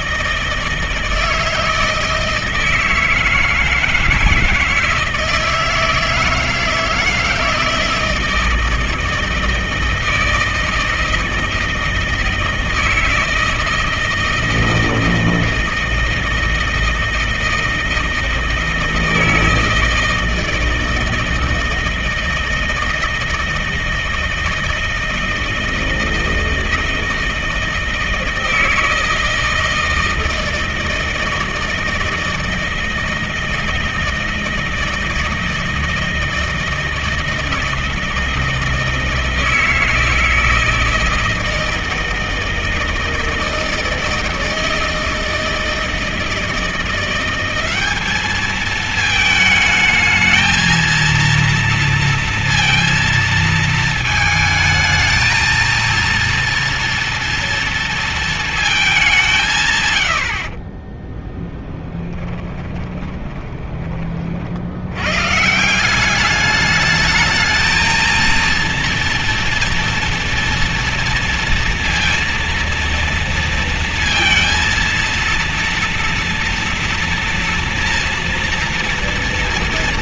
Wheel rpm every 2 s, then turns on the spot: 160, 160, 160, 160, 160, 160, 160, 160, 160, 160, 160, 160, 160, 160, 160, 160, 160, 160, 160, 160, 160, 160, 160, 180, 220, 230, 230, 220, 240, 190, 30, 20, 110, 210, 230, 230, 230, 230, 230, 230.
62-64